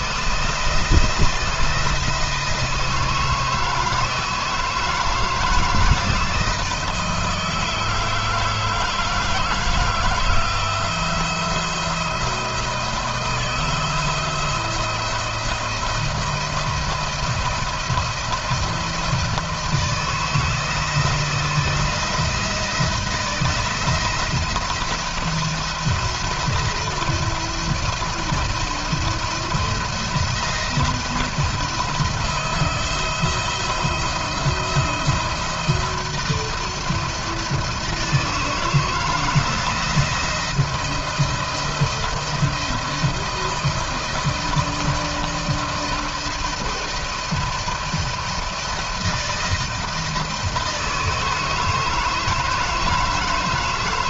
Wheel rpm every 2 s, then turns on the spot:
170, 160, 160, 160, 160, 160, 170, 170, 170, 160, 160, 160, 170, 170, 170, 160, 170, 170, 170, 160, 170, 170, 170, 160, 160, 160, 160.
none